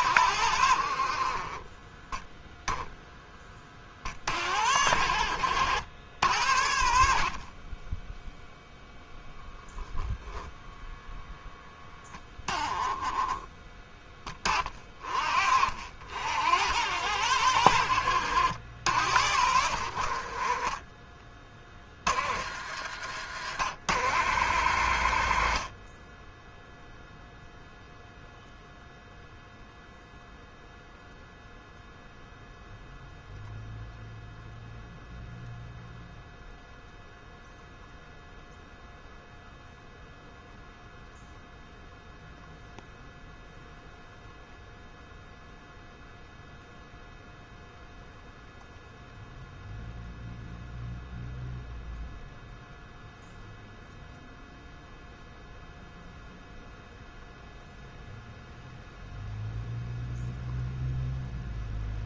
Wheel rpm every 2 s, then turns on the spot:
40, 10, 70, 40, 0, 0, 10, 40, 80, 80, 30, 80, 70, 0, 0, 0, 0, 0, 0, 0, 0, 0, 0, 0, 0, 0, 0, 0, 0, 0, 0.
none